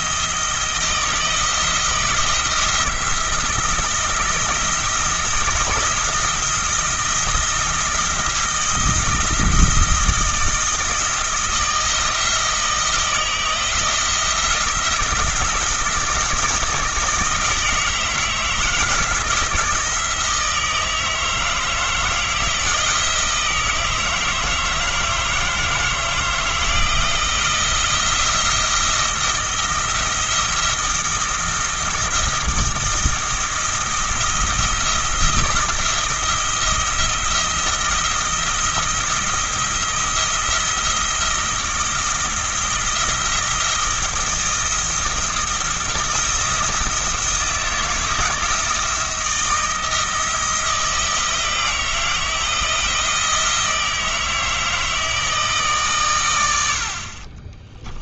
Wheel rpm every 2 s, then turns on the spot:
160, 170, 160, 170, 170, 170, 170, 170, 160, 160, 160, 160, 160, 160, 170, 170, 170, 170, 170, 170, 170, 170, 170, 160, 170, 160, 170, 160, 60.
none